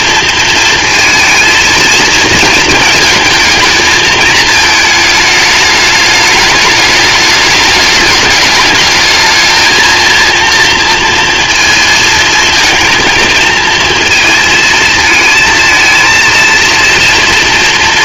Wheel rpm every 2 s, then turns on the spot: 230, 220, 220, 210, 210, 230, 230, 230, 230.
none